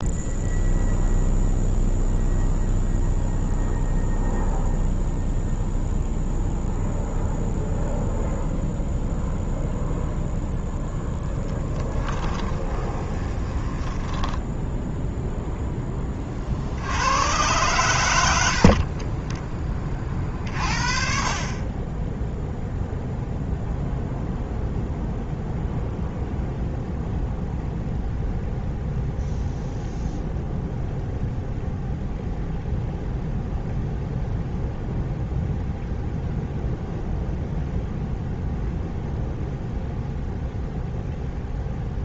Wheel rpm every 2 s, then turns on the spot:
0, 0, 0, 0, 0, 0, 20, 0, 80, 20, 40, 0, 0, 0, 0, 0, 0, 0, 0, 0, 0.
12-14 18-20